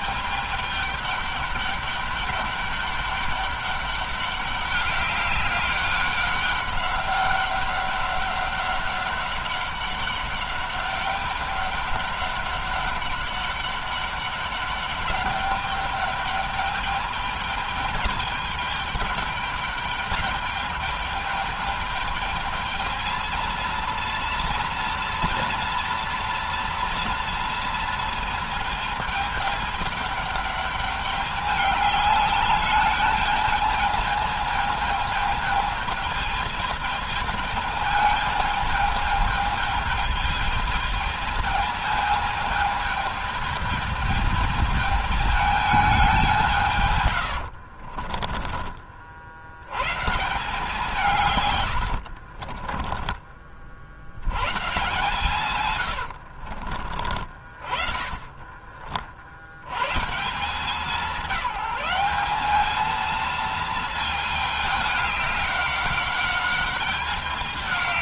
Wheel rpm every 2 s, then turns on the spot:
210, 200, 200, 200, 200, 200, 200, 200, 210, 210, 210, 220, 230, 230, 230, 210, 210, 220, 210, 220, 220, 220, 210, 160, 30, 150, 30, 120, 50, 30, 170, 210, 210, 200.
52-54 56-60